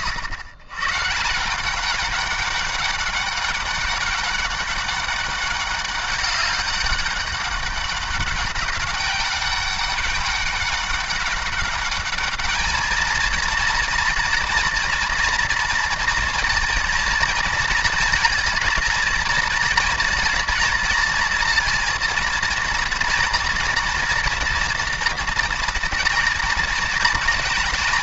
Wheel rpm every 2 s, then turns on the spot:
120, 200, 200, 200, 200, 190, 220, 240, 230, 230, 230, 230, 230, 230.
none